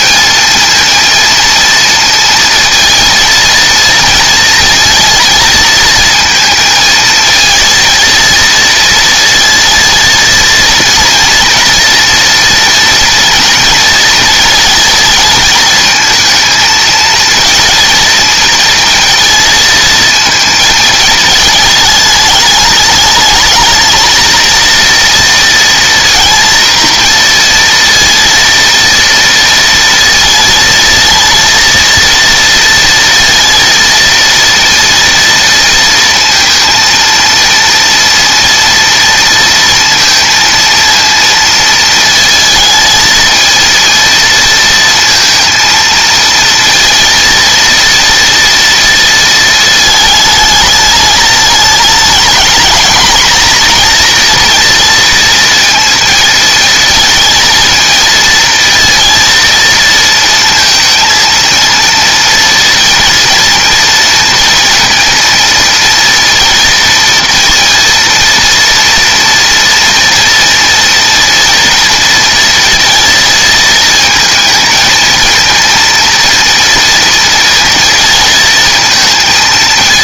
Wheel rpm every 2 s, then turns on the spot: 230, 230, 230, 230, 230, 230, 230, 220, 220, 230, 220, 210, 230, 230, 230, 230, 230, 230, 230, 230, 230, 220, 230, 230, 230, 220, 220, 230, 220, 230, 230, 230, 230, 230, 230, 230, 230, 220, 230, 230.
none